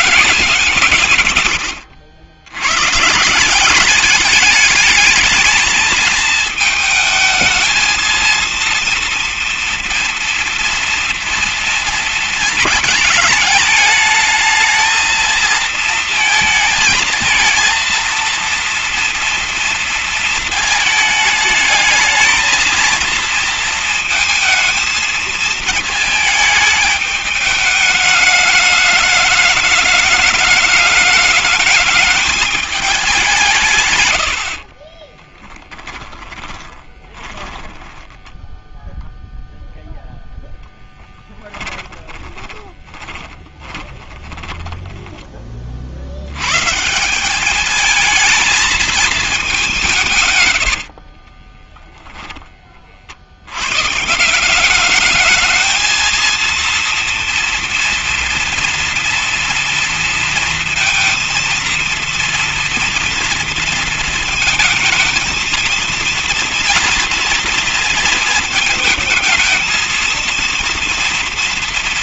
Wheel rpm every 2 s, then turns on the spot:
150, 100, 210, 220, 230, 230, 220, 220, 230, 230, 230, 220, 220, 210, 210, 210, 210, 70, 20, 10, 0, 20, 20, 120, 230, 130, 20, 190, 230, 230, 230, 230, 230, 230, 220, 230.
34-40 42-46 50-52